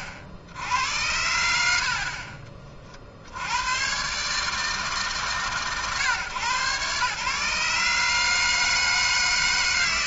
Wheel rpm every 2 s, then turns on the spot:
50, 60, 150, 120, 150.
none